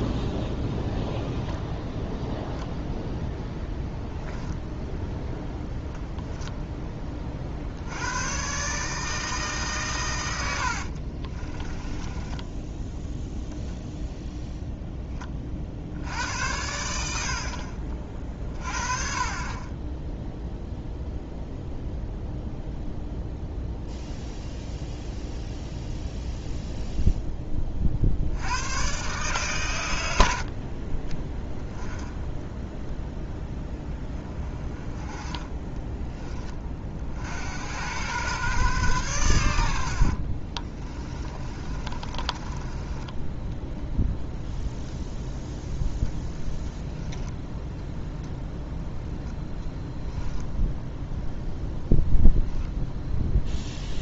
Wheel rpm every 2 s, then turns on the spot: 0, 0, 0, 10, 140, 70, 10, 0, 80, 30, 0, 0, 0, 0, 100, 50, 0, 20, 30, 120, 30, 20, 0, 0, 0, 0, 0.
10-14 40-44